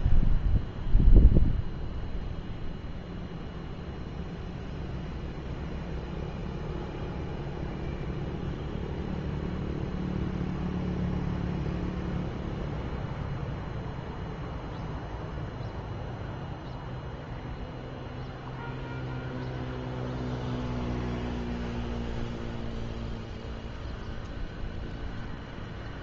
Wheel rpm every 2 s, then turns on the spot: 0, 0, 0, 0, 0, 0, 0, 0, 0, 0, 0, 0, 0.
none